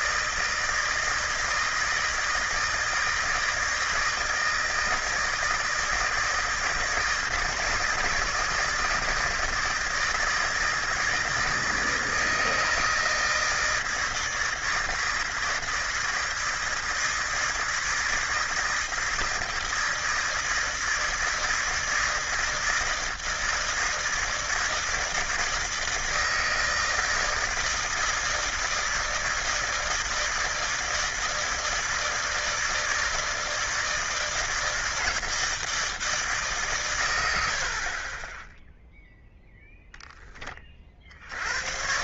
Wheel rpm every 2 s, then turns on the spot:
160, 160, 160, 160, 160, 160, 160, 160, 160, 160, 160, 160, 160, 160, 160, 160, 160, 160, 150, 20, 20.
none